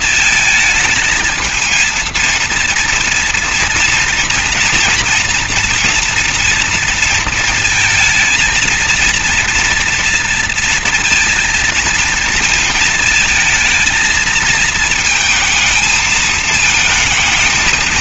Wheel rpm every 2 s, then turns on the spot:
220, 230, 230, 230, 230, 230, 220, 220, 220.
none